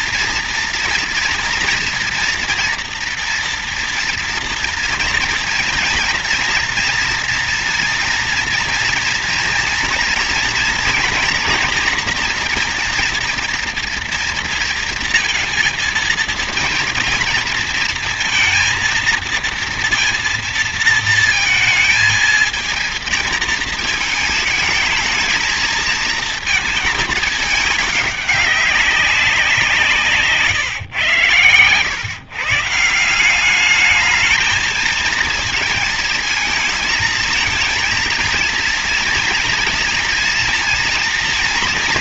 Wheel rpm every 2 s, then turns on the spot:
230, 230, 230, 230, 230, 230, 240, 230, 230, 230, 230, 230, 220, 220, 200, 140, 150, 220, 230, 230, 230.
none